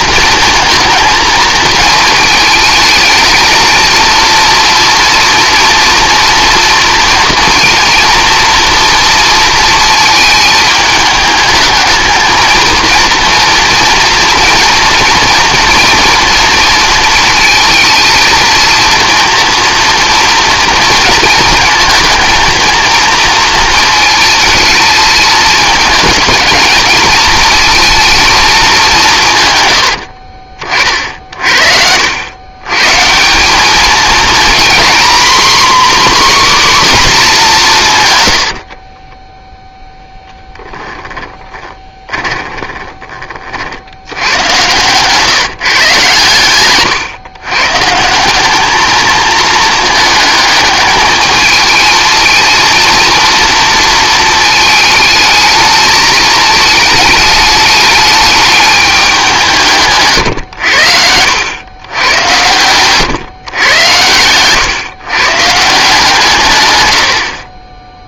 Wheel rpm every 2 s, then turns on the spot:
230, 220, 230, 230, 230, 220, 230, 230, 230, 230, 230, 220, 220, 220, 200, 40, 120, 230, 270, 60, 10, 20, 110, 120, 200, 220, 230, 220, 220, 210, 90, 110, 120, 120.
38-44 62-64